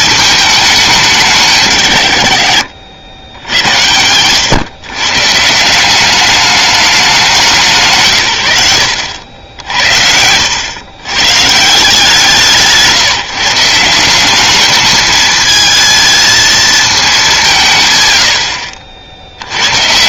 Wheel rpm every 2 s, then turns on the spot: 210, 70, 120, 210, 100, 100, 170, 210, 220, 60.
none